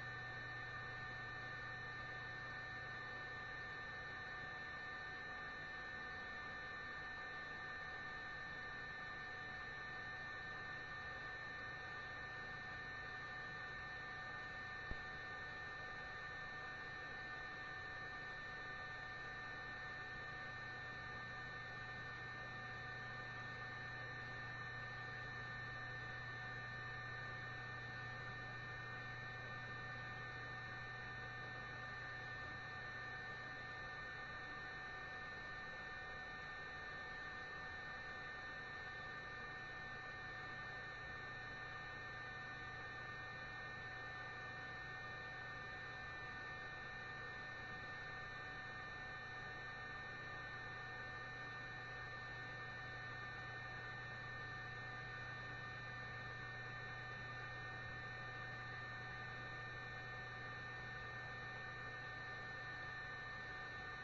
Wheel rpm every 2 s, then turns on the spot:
0, 0, 0, 0, 0, 0, 0, 0, 0, 0, 0, 0, 0, 0, 0, 0, 0, 0, 0, 0, 0, 0, 0, 0, 0, 0, 0, 0, 0, 0, 0, 0.
none